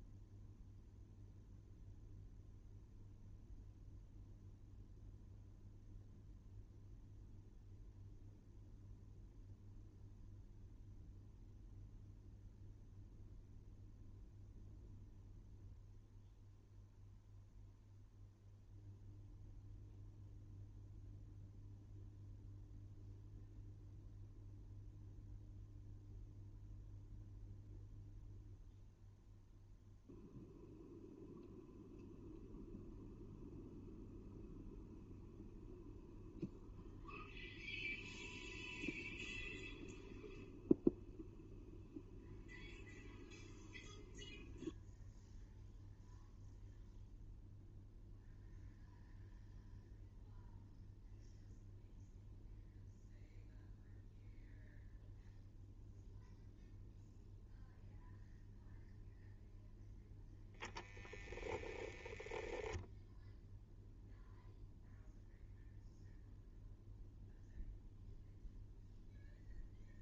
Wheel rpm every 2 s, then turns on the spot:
0, 0, 0, 0, 0, 0, 0, 0, 0, 0, 0, 0, 0, 0, 0, 0, 0, 0, 0, 0, 0, 0, 0, 0, 0, 0, 0, 0, 0, 0, 0, 10, 0, 0, 0.
none